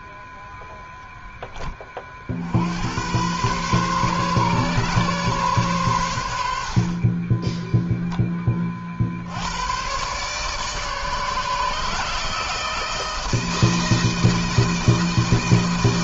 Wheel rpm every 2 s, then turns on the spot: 0, 100, 130, 50, 60, 150, 160, 160.
none